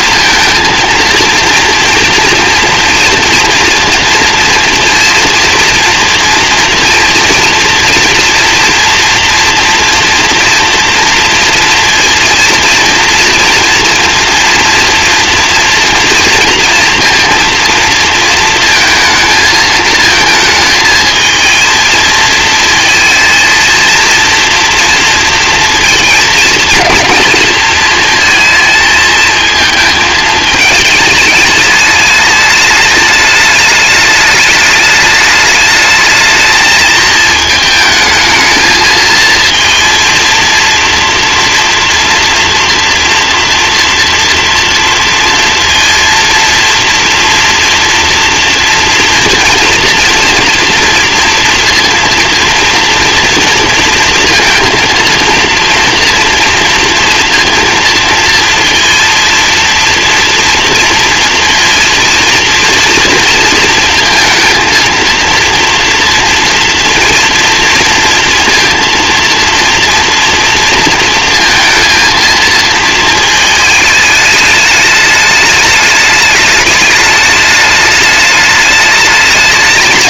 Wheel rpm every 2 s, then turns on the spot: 230, 230, 230, 230, 230, 230, 230, 230, 230, 230, 220, 230, 230, 230, 220, 210, 210, 210, 220, 220, 230, 240, 230, 230, 230, 230, 240, 230, 230, 230, 230, 230, 230, 230, 230, 230, 230, 210, 210, 210.
none